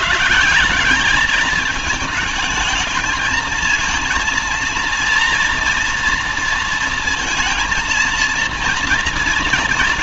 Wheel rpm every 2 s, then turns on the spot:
190, 220, 230, 230, 230.
none